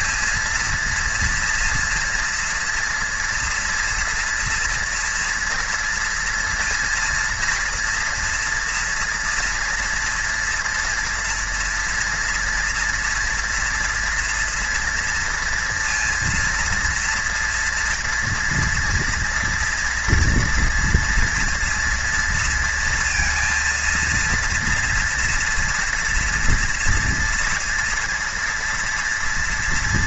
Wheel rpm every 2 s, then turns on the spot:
230, 230, 230, 230, 230, 240, 230, 230, 240, 230, 230, 230, 230, 240, 230.
none